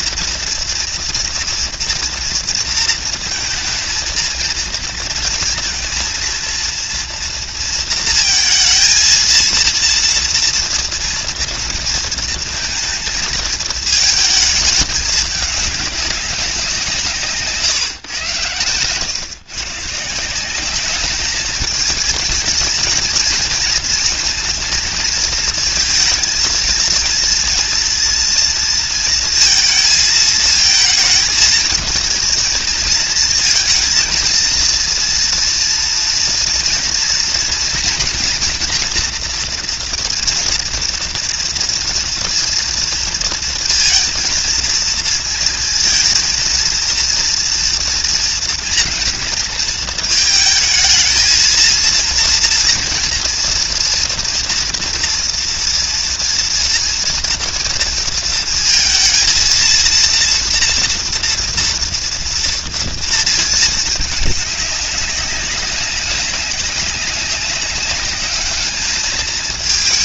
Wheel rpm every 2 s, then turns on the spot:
230, 230, 230, 230, 230, 230, 230, 220, 190, 110, 190, 230, 230, 230, 230, 230, 220, 230, 230, 230, 230, 230, 230, 230, 230, 220, 230, 230, 230, 230, 230, 230, 210, 200, 210.
none